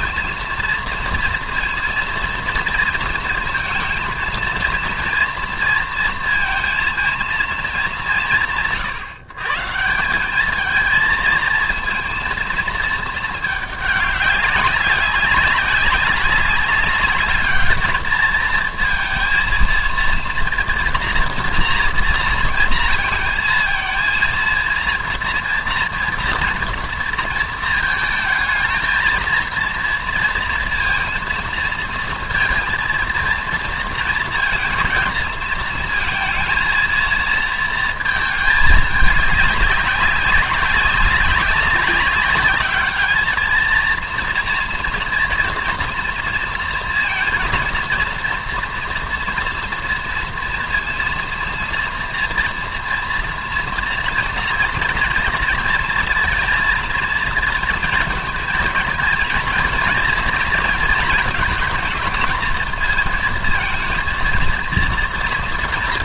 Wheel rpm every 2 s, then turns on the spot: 230, 230, 230, 230, 140, 220, 220, 200, 200, 230, 230, 230, 230, 230, 220, 230, 230, 230, 230, 210, 200, 220, 230, 230, 240, 230, 240, 230, 230, 230, 230, 230, 230.
none